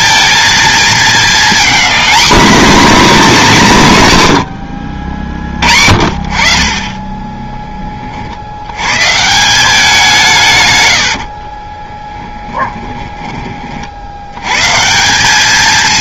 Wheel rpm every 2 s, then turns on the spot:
220, 240, 80, 30, 110, 110, 10, 150.
12-14